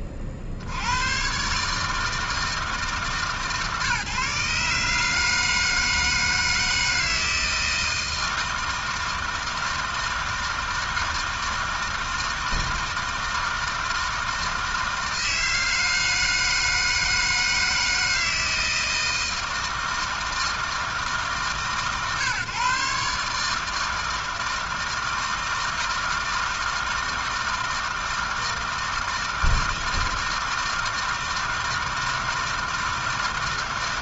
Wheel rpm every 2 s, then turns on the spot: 70, 160, 150, 160, 160, 160, 160, 160, 160, 160, 160, 140, 160, 160, 160, 160, 160.
none